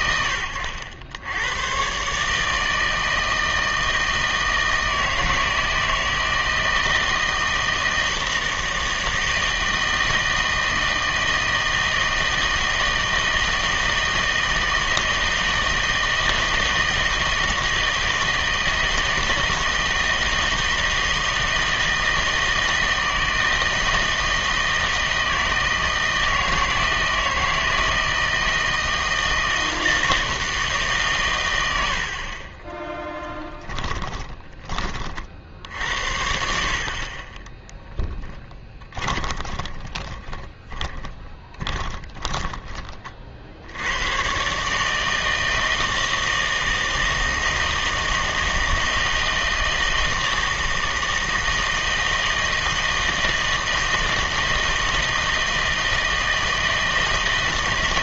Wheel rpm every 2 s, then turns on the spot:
90, 160, 160, 160, 160, 160, 160, 160, 160, 160, 160, 160, 160, 160, 160, 150, 10, 30, 60, 20, 20, 30, 150, 160, 160, 160, 160, 160, 160.
32-34 38-42